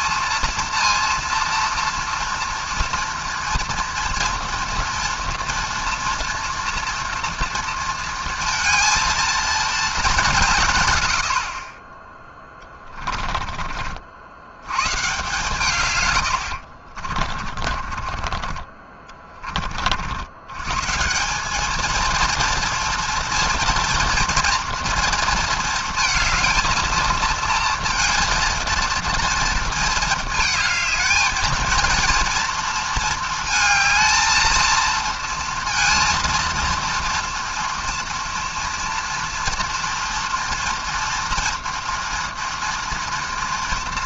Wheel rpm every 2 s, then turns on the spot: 230, 240, 240, 230, 230, 150, 10, 80, 80, 30, 100, 230, 230, 220, 230, 220, 230, 230, 230, 230, 240, 230.
12-14 18-20